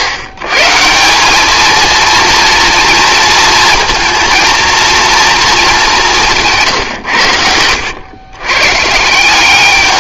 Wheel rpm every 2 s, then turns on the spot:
140, 230, 230, 160, 130.
none